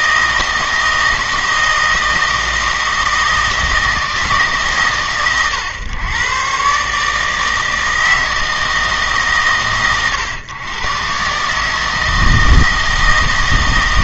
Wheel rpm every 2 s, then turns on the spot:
160, 160, 140, 140, 160, 110, 160.
none